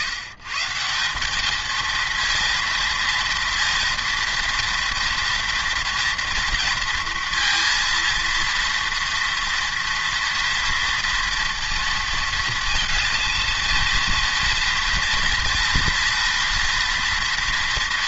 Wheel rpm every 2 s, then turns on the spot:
160, 230, 230, 230, 230, 230, 230, 230, 230.
none